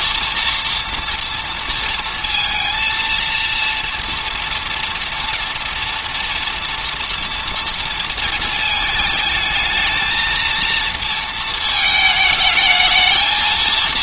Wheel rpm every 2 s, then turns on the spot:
230, 230, 230, 230, 220, 230, 220.
none